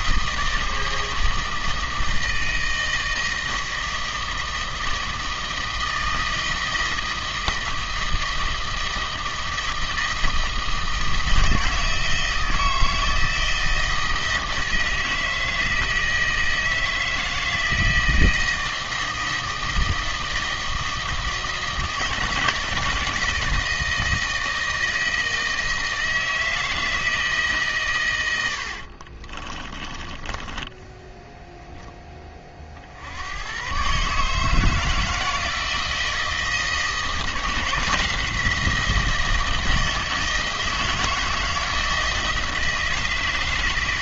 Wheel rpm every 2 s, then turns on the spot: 160, 160, 160, 160, 160, 160, 160, 160, 160, 160, 160, 160, 160, 160, 70, 10, 40, 160, 160, 170, 160, 160.
28-32